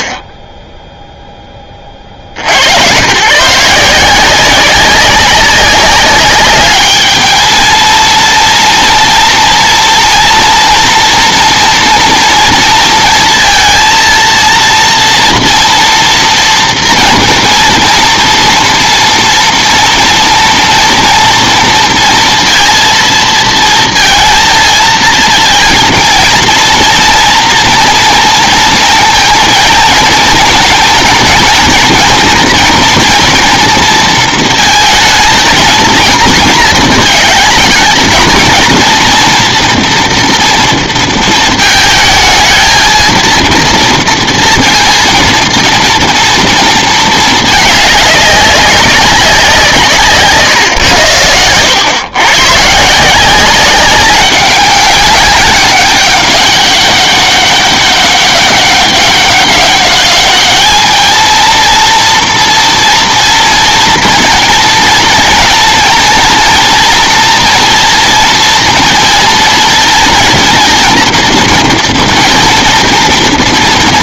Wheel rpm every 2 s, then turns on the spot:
10, 80, 180, 200, 230, 230, 230, 230, 230, 230, 230, 230, 230, 230, 230, 230, 240, 220, 220, 230, 230, 230, 230, 230, 200, 120, 140, 200, 200, 200, 210, 230, 230, 230, 230, 230, 230.
none